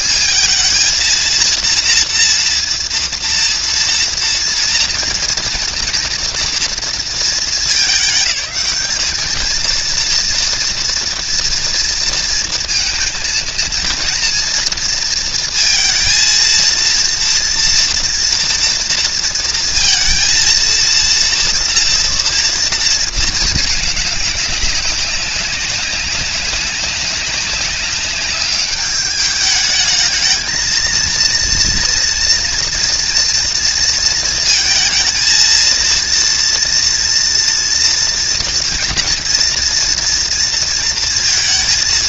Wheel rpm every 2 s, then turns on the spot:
220, 230, 240, 230, 210, 230, 230, 230, 230, 230, 230, 240, 200, 200, 210, 230, 230, 230, 230, 240, 230.
none